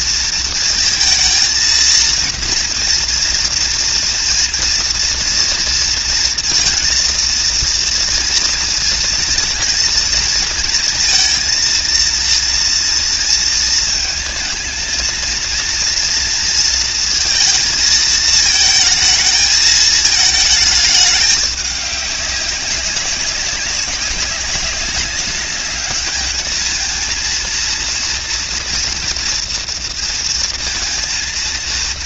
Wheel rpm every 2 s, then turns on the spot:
230, 230, 230, 230, 230, 230, 230, 220, 230, 220, 220, 200, 190, 210, 230, 230.
none